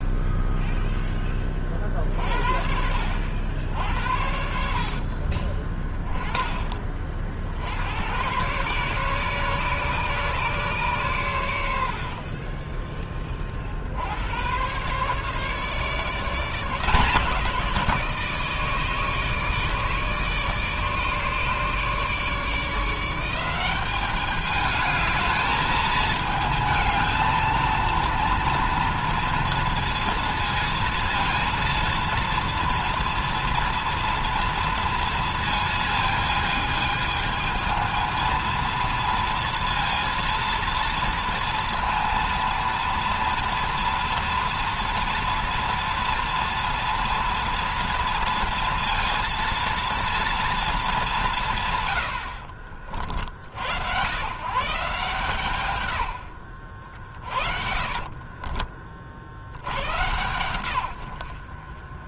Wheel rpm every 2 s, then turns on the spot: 0, 50, 60, 20, 110, 140, 30, 90, 160, 160, 150, 150, 210, 220, 230, 230, 230, 230, 220, 220, 230, 230, 230, 230, 230, 230, 80, 130, 90, 40, 110.
12-14 52-54 58-60